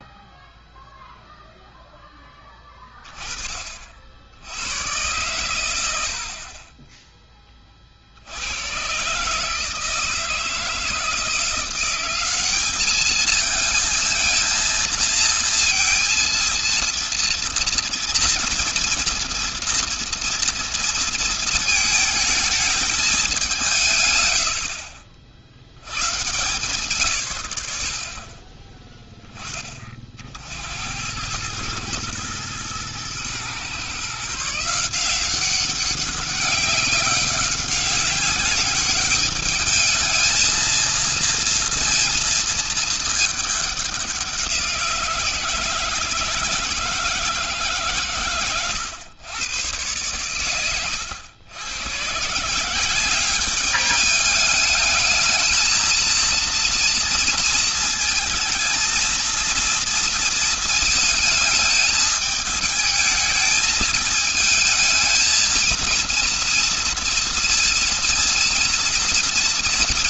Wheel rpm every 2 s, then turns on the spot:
0, 20, 100, 20, 140, 170, 210, 230, 230, 230, 220, 200, 40, 120, 20, 90, 120, 180, 200, 210, 230, 220, 170, 150, 110, 100, 190, 220, 230, 230, 220, 220, 230, 230, 230.
none